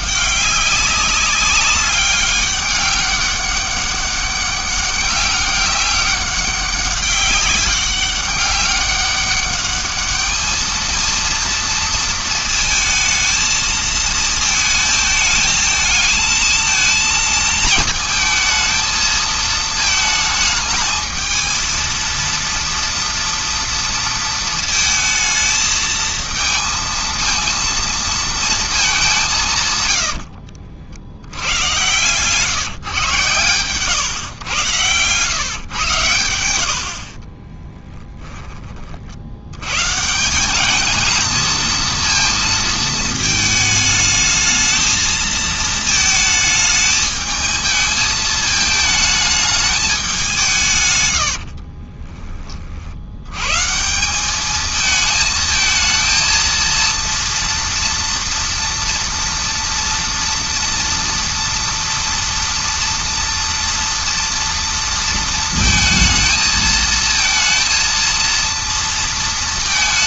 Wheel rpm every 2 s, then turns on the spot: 200, 200, 200, 190, 200, 220, 220, 220, 220, 220, 220, 230, 230, 230, 210, 60, 140, 100, 80, 30, 210, 230, 220, 220, 220, 140, 50, 220, 230, 230, 230, 230, 230, 220, 230.
34-36